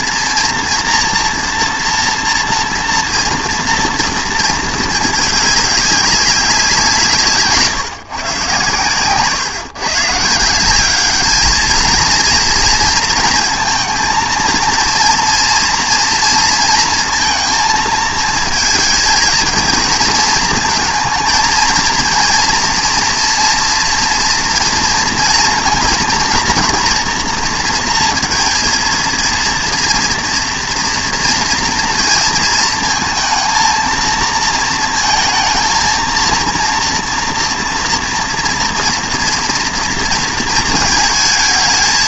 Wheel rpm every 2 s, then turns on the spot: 230, 240, 220, 170, 120, 190, 230, 230, 230, 220, 230, 230, 230, 230, 230, 230, 220, 220, 230, 230, 230.
none